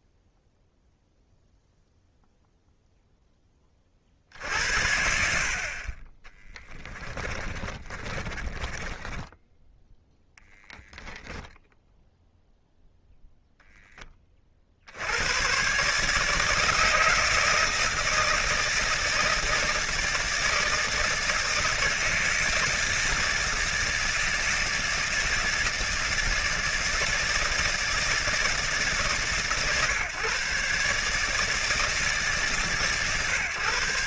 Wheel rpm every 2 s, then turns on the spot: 0, 0, 60, 20, 20, 10, 0, 40, 160, 160, 160, 160, 160, 160, 150, 140, 140.
6-10